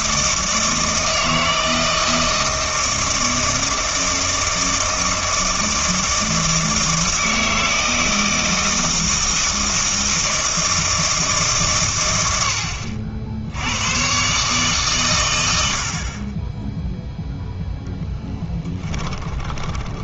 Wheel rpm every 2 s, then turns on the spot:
160, 160, 160, 160, 160, 160, 80, 140, 10, 10.
18-20